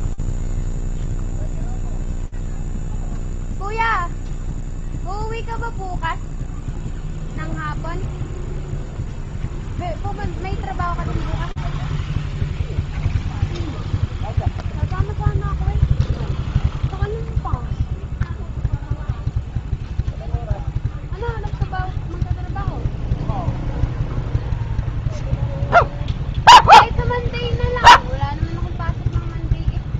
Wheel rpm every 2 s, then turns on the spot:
0, 0, 0, 0, 0, 0, 0, 0, 0, 0, 0, 0, 0, 0, 0.
none